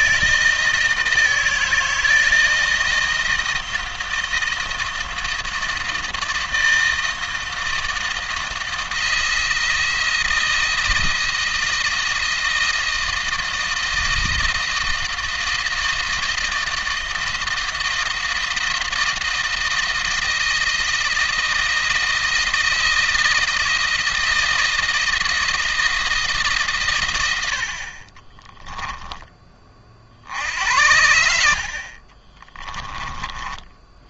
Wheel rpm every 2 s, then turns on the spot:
160, 160, 160, 160, 160, 160, 160, 160, 160, 160, 160, 160, 160, 140, 10, 70, 20.
28-30